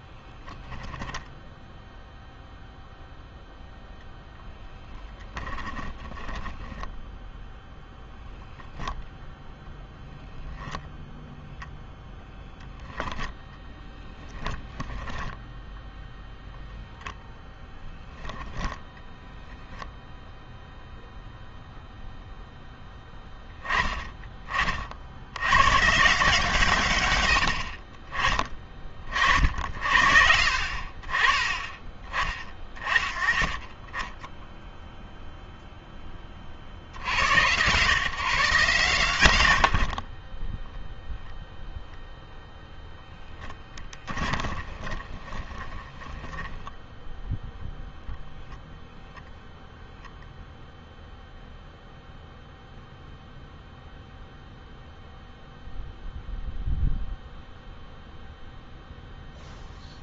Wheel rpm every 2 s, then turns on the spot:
10, 0, 0, 10, 0, 0, 0, 20, 10, 10, 0, 0, 30, 130, 40, 50, 20, 10, 40, 140, 20, 0, 20, 10, 0, 0, 0, 0, 0, 0.
0-2 6-8 14-16 44-48